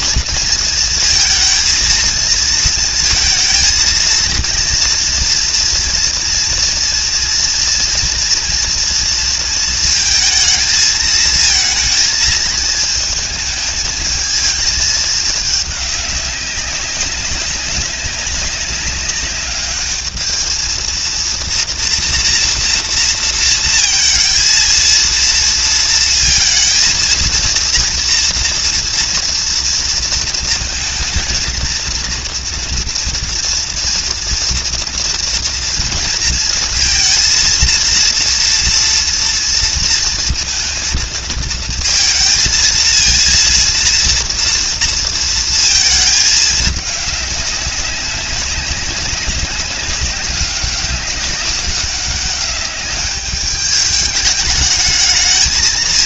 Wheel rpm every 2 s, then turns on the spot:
230, 220, 230, 230, 230, 220, 220, 210, 200, 200, 230, 230, 230, 230, 230, 230, 230, 230, 230, 230, 230, 220, 230, 200, 190, 200, 200, 210.
none